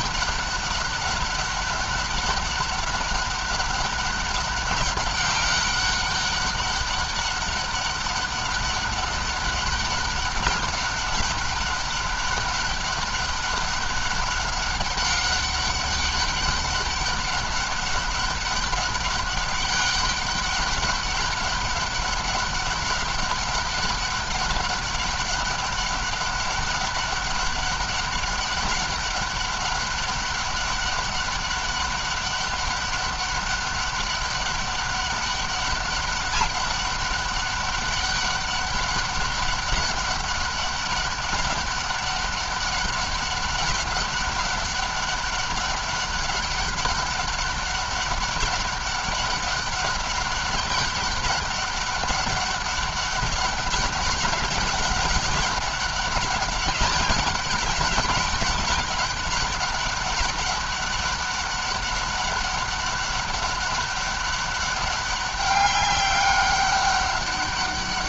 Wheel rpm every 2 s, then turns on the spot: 200, 200, 200, 200, 200, 200, 200, 190, 200, 200, 200, 200, 200, 200, 200, 200, 200, 200, 200, 190, 200, 200, 200, 200, 200, 200, 200, 200, 200, 200, 200, 200, 200, 200.
none